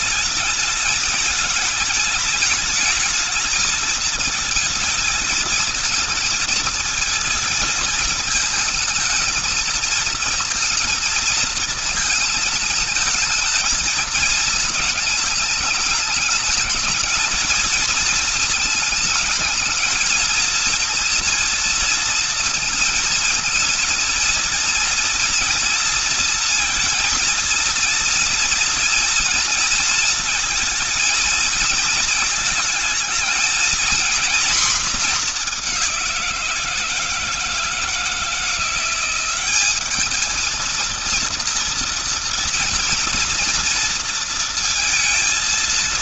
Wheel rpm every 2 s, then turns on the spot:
220, 220, 220, 220, 220, 220, 220, 220, 220, 220, 230, 230, 230, 220, 230, 220, 220, 230, 170, 180, 230, 230, 230.
none